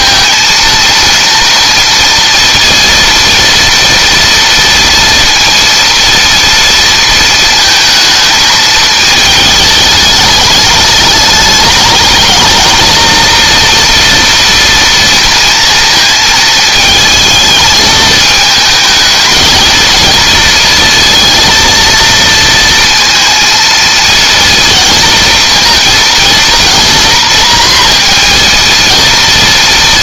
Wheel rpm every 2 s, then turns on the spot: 230, 230, 230, 230, 220, 210, 230, 230, 220, 220, 230, 230, 230, 230, 230.
none